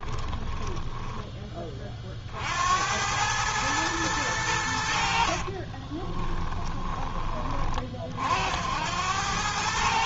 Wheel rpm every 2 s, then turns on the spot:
10, 50, 100, 10, 60.
none